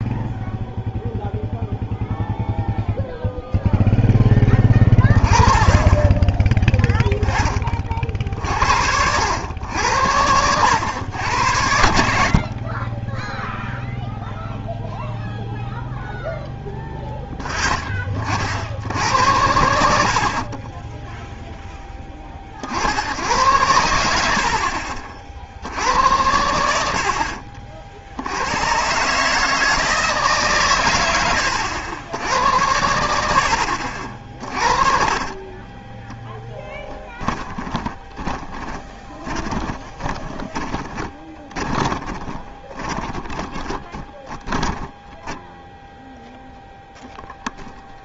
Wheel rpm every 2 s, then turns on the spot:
0, 0, 20, 10, 70, 100, 30, 0, 10, 70, 20, 50, 60, 70, 110, 120, 80, 30, 20, 20, 20, 20, 10, 0.
34-46